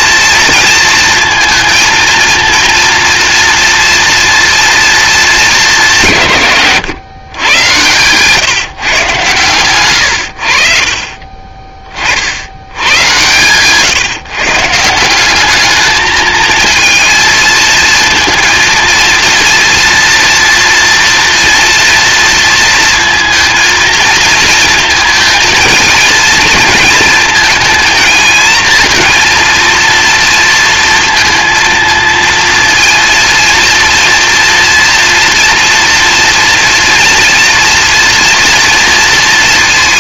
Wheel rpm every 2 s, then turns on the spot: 230, 230, 230, 150, 140, 60, 100, 150, 220, 230, 230, 230, 230, 230, 220, 230, 230, 230, 230, 230.
none